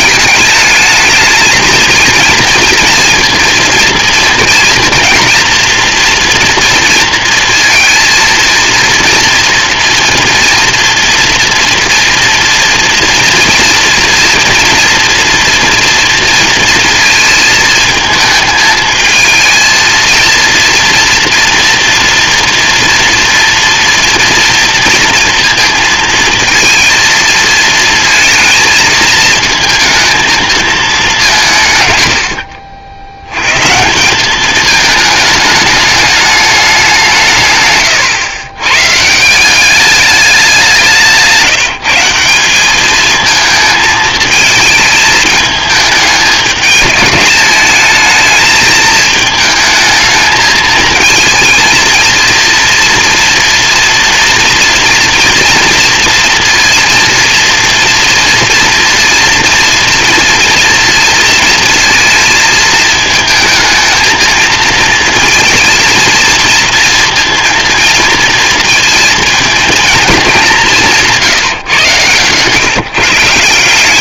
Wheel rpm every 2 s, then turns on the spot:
220, 230, 230, 230, 230, 230, 230, 230, 230, 220, 230, 230, 240, 230, 220, 220, 60, 210, 200, 130, 190, 200, 220, 210, 220, 220, 230, 230, 230, 230, 230, 220, 230, 230, 230, 180, 150.
none